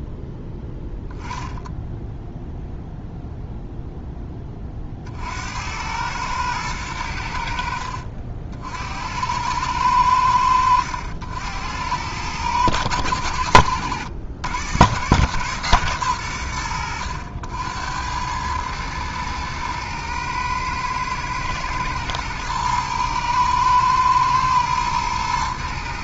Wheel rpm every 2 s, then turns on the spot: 0, 0, 30, 110, 70, 80, 110, 110, 100, 110, 110, 110, 120.
none